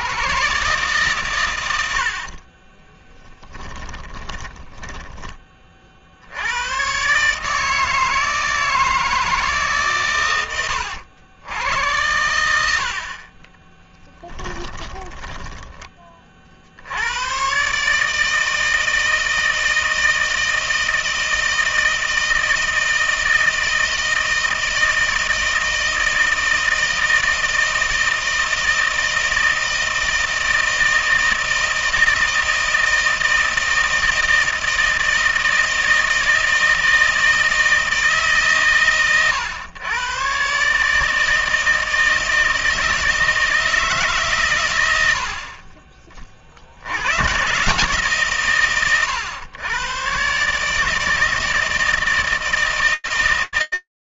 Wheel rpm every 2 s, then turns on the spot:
130, 40, 10, 120, 160, 90, 70, 10, 50, 160, 160, 160, 160, 160, 160, 160, 160, 160, 160, 140, 130, 160, 140, 30, 140, 140, 160.
2-6 14-16